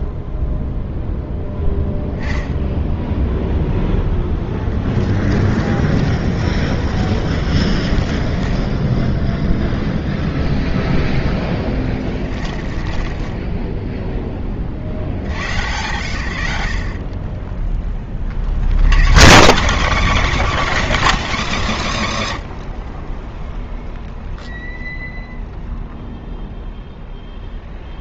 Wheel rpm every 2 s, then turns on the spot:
0, 0, 10, 50, 20, 0, 30, 30, 50, 150, 330, 60, 0, 0.
4-10 12-14